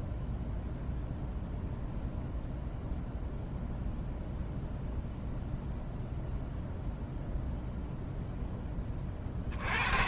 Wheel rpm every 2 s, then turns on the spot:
0, 0, 0, 0, 20.
none